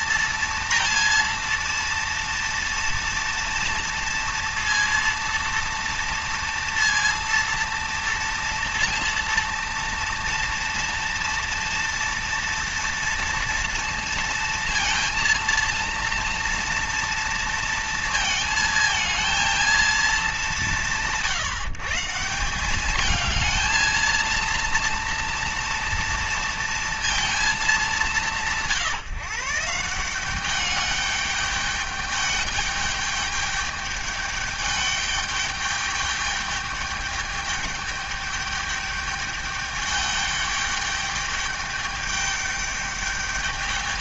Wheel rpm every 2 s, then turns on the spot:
230, 230, 230, 230, 230, 230, 230, 230, 230, 230, 170, 190, 230, 230, 160, 200, 210, 210, 210, 210, 210, 210.
none